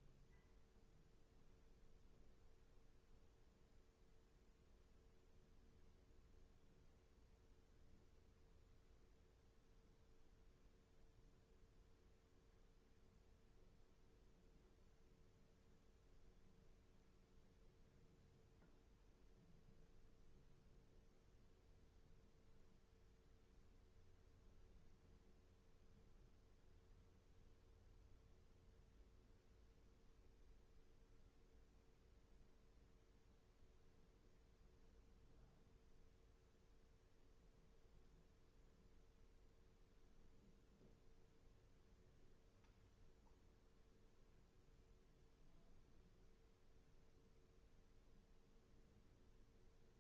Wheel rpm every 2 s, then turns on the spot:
0, 0, 0, 0, 0, 0, 0, 0, 0, 0, 0, 0, 0, 0, 0, 0, 0, 0, 0, 0, 0, 0, 0, 0, 0.
none